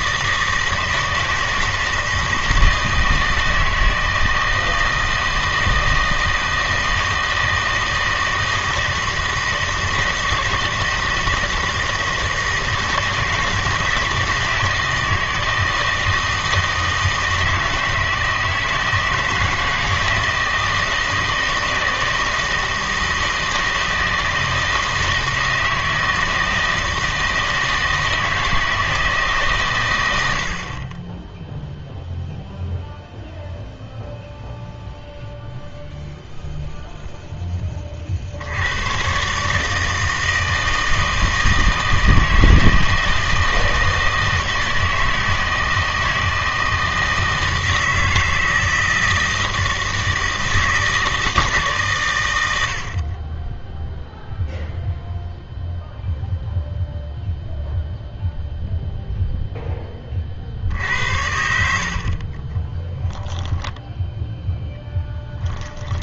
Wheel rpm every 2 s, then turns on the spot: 160, 160, 160, 160, 160, 160, 160, 160, 160, 160, 160, 160, 160, 160, 160, 50, 0, 0, 0, 90, 160, 160, 160, 160, 160, 160, 80, 0, 0, 0, 60, 20, 10.
62-66